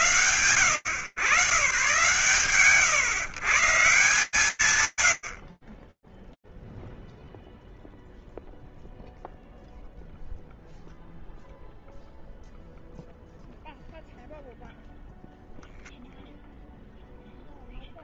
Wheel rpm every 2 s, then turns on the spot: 90, 160, 60, 0, 0, 0, 0, 0, 0.
none